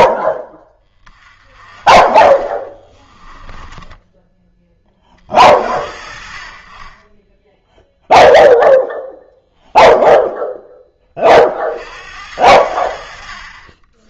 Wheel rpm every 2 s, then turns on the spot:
20, 20, 30, 30, 10, 10, 70.
2-4